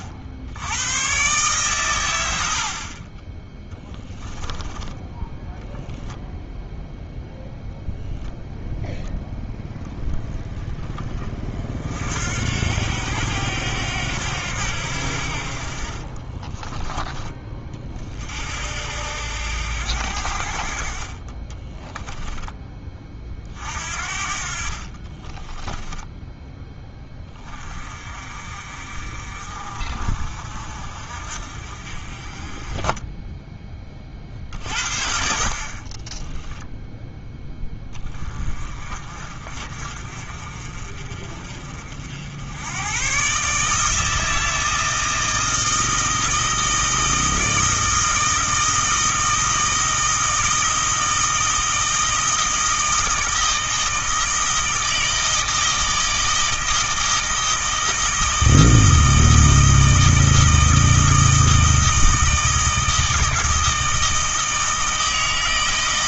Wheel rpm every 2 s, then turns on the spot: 100, 50, 10, 0, 0, 20, 80, 80, 20, 70, 50, 30, 40, 10, 50, 50, 20, 40, 10, 40, 40, 100, 160, 160, 160, 160, 160, 160, 160, 160, 160, 160, 160.
24-26